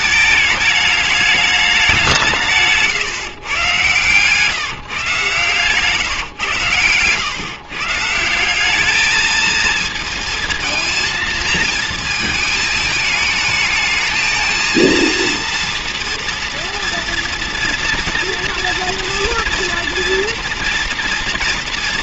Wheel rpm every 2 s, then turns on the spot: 210, 150, 150, 120, 180, 230, 220, 220, 230, 230, 230.
none